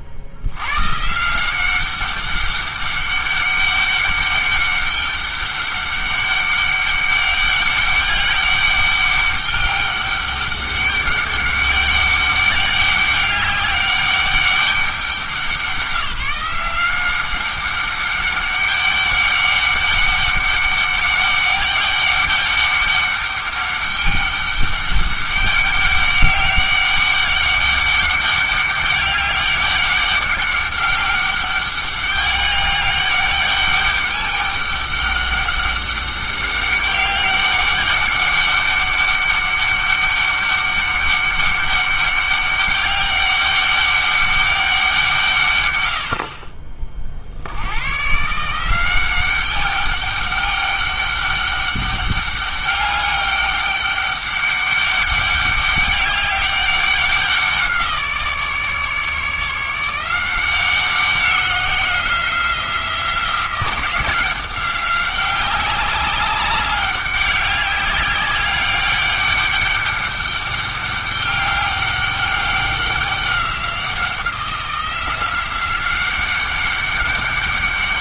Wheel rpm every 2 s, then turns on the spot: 100, 200, 200, 200, 200, 200, 200, 200, 180, 200, 200, 200, 200, 200, 200, 200, 200, 200, 200, 200, 200, 200, 190, 40, 160, 200, 200, 200, 190, 150, 180, 180, 190, 200, 200, 200, 190, 180, 190.
none